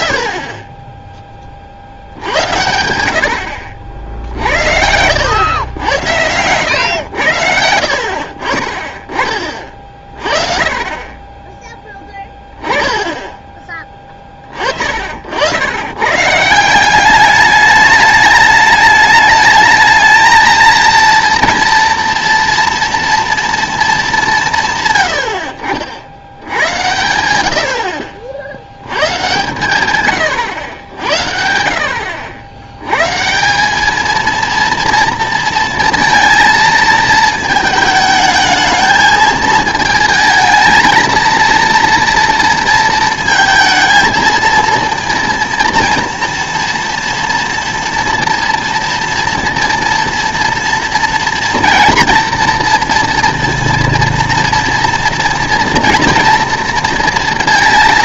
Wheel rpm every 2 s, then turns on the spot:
30, 80, 70, 100, 40, 30, 10, 40, 170, 210, 220, 230, 150, 90, 80, 100, 90, 230, 230, 220, 220, 230, 230, 230, 230, 230, 230, 240, 230.
none